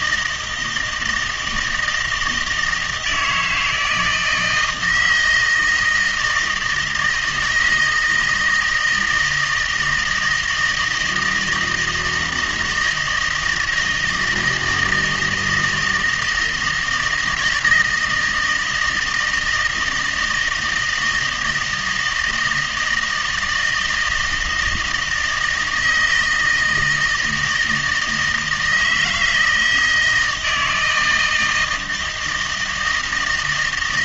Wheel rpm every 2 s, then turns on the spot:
160, 160, 170, 160, 160, 160, 160, 160, 160, 160, 160, 160, 160, 160, 160, 160, 160.
none